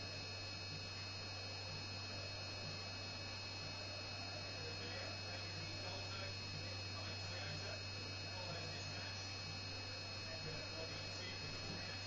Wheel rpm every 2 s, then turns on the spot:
0, 0, 0, 0, 0, 0.
none